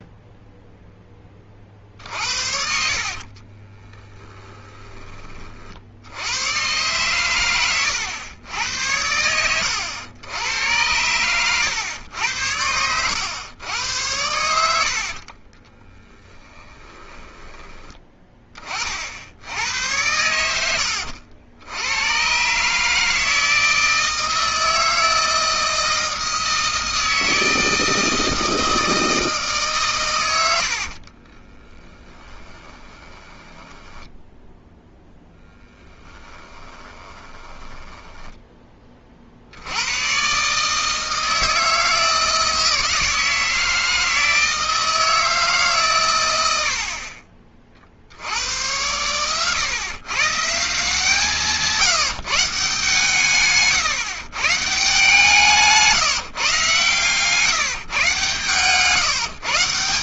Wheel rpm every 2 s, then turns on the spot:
0, 60, 10, 110, 100, 90, 90, 80, 10, 30, 90, 140, 160, 160, 160, 90, 20, 0, 20, 10, 130, 160, 160, 90, 90, 170, 160, 140, 140, 140.
16-18 20-22 30-34 36-38